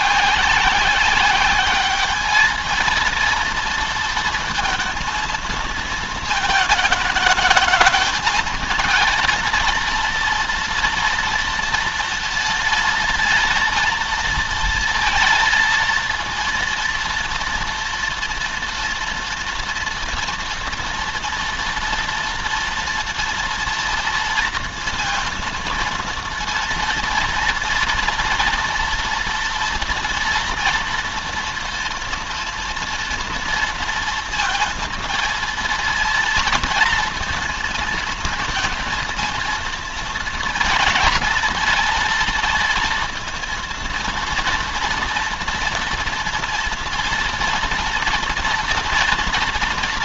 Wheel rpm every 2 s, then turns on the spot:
190, 220, 230, 220, 220, 240, 230, 230, 230, 230, 230, 230, 230, 230, 230, 230, 230, 230, 230, 230, 220, 230, 230, 230, 230.
none